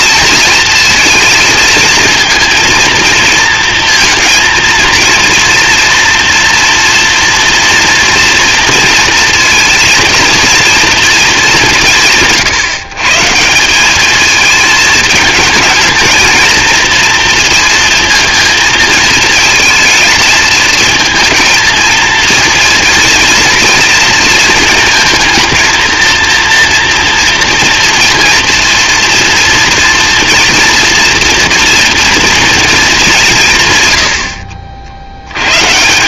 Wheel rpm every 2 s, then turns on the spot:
230, 230, 230, 230, 230, 230, 150, 220, 230, 230, 220, 230, 220, 240, 230, 230, 220, 70.
none